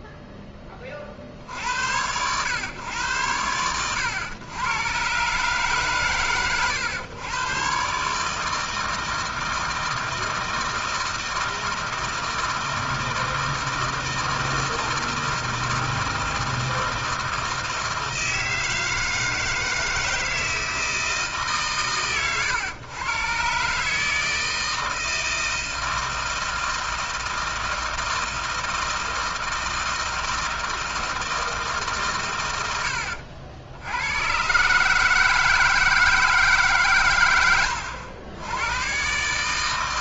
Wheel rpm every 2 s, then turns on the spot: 10, 110, 110, 110, 160, 160, 160, 160, 160, 160, 160, 100, 160, 160, 160, 160, 90, 140, 160, 110.
32-34